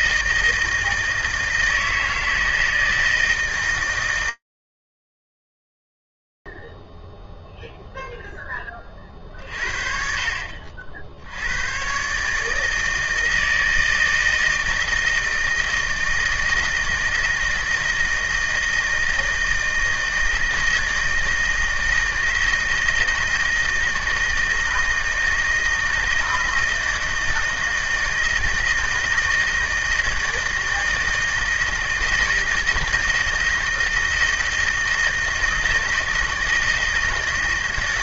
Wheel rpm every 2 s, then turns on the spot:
160, 160, 150, 20, 0, 60, 150, 160, 160, 160, 160, 160, 160, 160, 160, 160, 160, 160, 160.
none